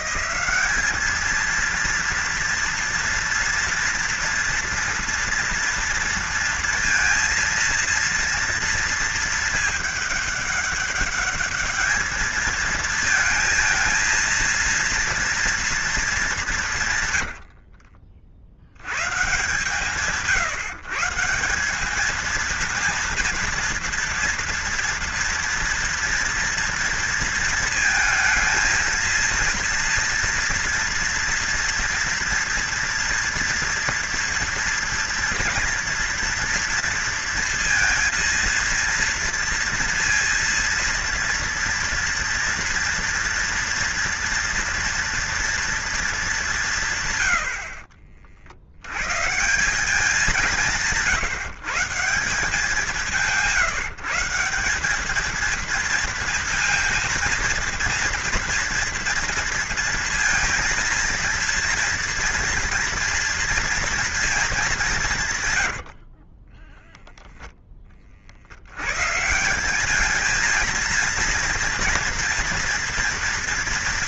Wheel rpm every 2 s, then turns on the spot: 210, 230, 230, 230, 230, 200, 220, 230, 160, 100, 150, 230, 230, 240, 220, 230, 230, 230, 230, 230, 230, 230, 240, 150, 100, 170, 180, 190, 230, 230, 230, 230, 180, 0, 120, 230, 230.
none